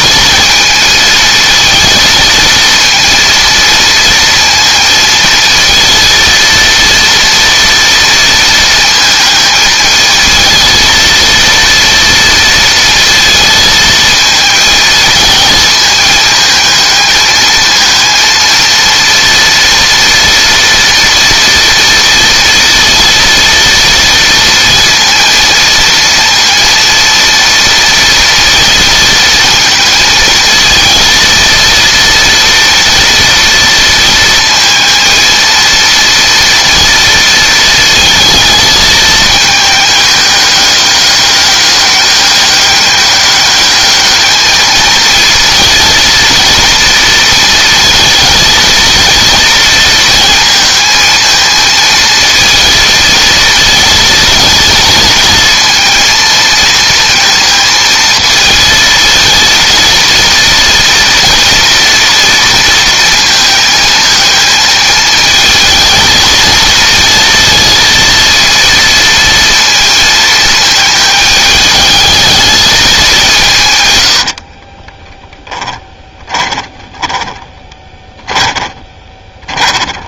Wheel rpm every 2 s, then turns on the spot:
220, 230, 230, 230, 230, 230, 230, 230, 220, 230, 230, 230, 230, 230, 230, 230, 230, 220, 230, 220, 200, 200, 220, 230, 230, 230, 220, 230, 230, 220, 230, 230, 220, 230, 230, 220, 210, 30, 20, 20.
74-80